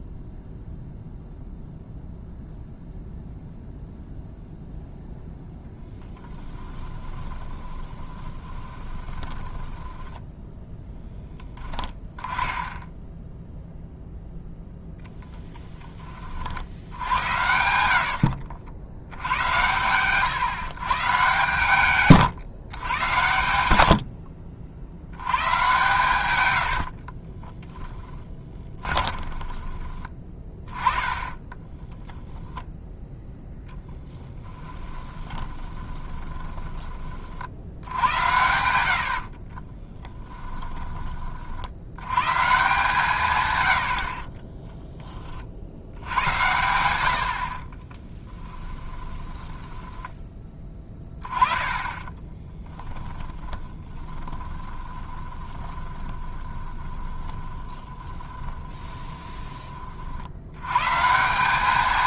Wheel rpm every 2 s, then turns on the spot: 0, 0, 0, 20, 20, 0, 10, 0, 70, 70, 130, 110, 60, 70, 20, 20, 10, 20, 20, 80, 20, 150, 10, 100, 10, 10, 10, 20, 20, 10, 110.
6-10 26-32 34-36 38-40 48-50 52-60